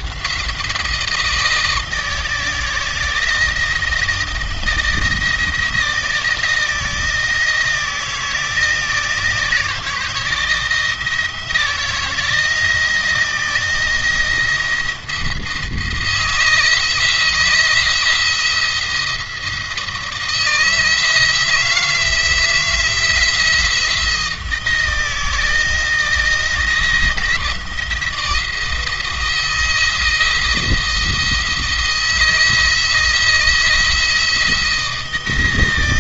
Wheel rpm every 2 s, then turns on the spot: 170, 160, 160, 160, 170, 160, 170, 170, 160, 170, 160, 170, 170, 170, 160, 170, 170, 170.
none